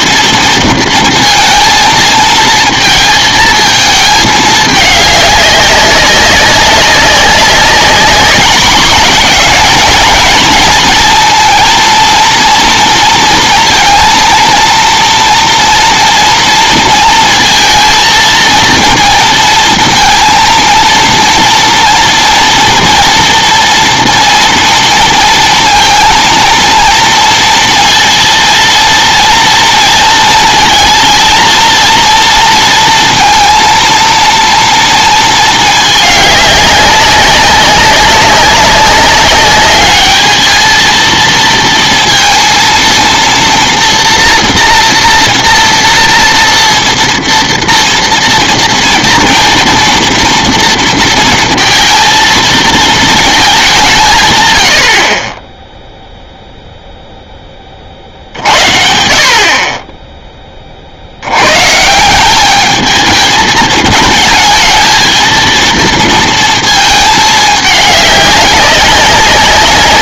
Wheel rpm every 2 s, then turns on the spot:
230, 220, 210, 200, 210, 220, 230, 230, 230, 230, 230, 230, 230, 230, 230, 230, 230, 230, 200, 200, 220, 230, 230, 230, 230, 230, 230, 100, 0, 70, 30, 200, 220, 230, 200.
none